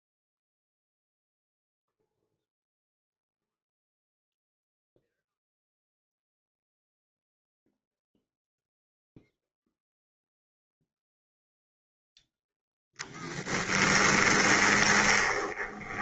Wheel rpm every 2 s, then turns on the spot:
0, 0, 0, 0, 0, 0, 10, 20.
12-16